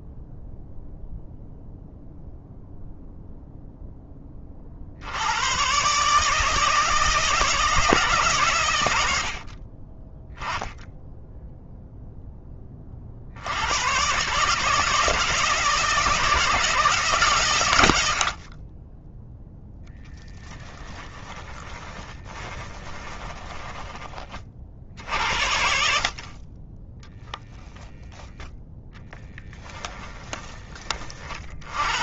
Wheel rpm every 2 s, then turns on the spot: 0, 0, 70, 160, 100, 10, 30, 160, 140, 20, 10, 20, 50, 10, 0, 40.
8-10 18-24 26-28